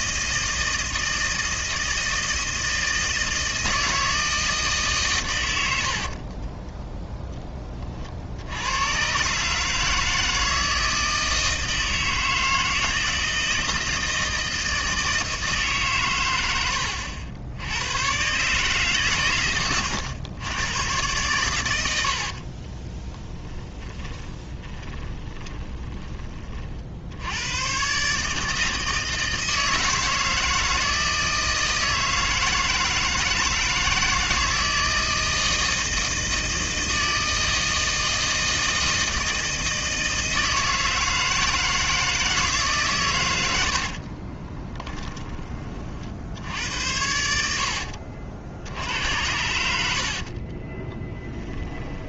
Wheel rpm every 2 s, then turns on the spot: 160, 160, 140, 10, 110, 160, 160, 160, 80, 140, 110, 20, 20, 60, 160, 160, 160, 160, 160, 160, 160, 140, 10, 80, 80, 10.
22-26 44-46 50-52